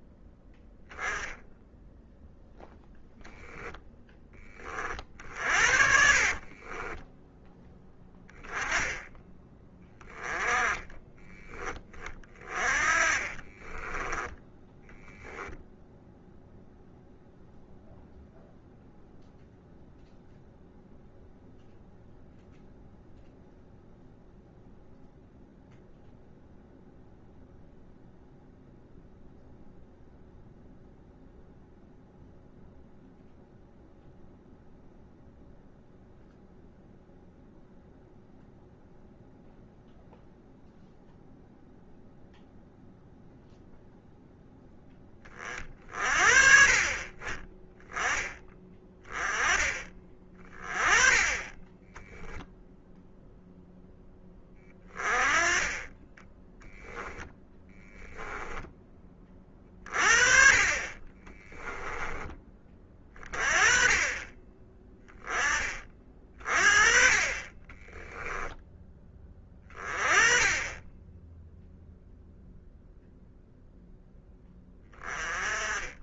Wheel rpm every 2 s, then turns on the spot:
10, 0, 40, 20, 10, 20, 30, 0, 0, 0, 0, 0, 0, 0, 0, 0, 0, 0, 0, 0, 0, 0, 10, 40, 20, 20, 0, 20, 10, 10, 30, 20, 20, 30, 10, 10, 0, 20.
6-8 10-12